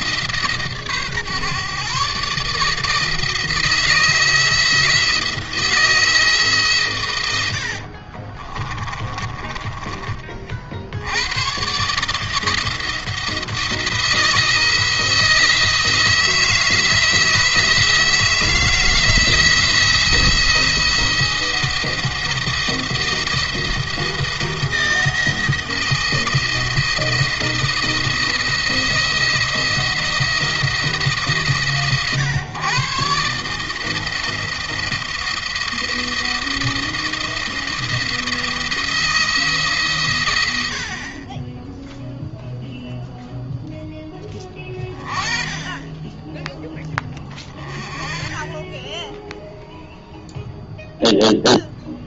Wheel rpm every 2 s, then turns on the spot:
150, 150, 160, 150, 30, 60, 160, 160, 160, 170, 170, 170, 170, 160, 170, 170, 130, 170, 160, 170, 80, 0, 20, 10, 10, 0.
8-10